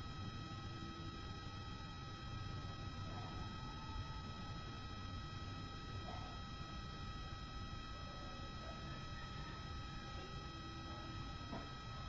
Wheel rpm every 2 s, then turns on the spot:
0, 0, 0, 0, 0, 0.
none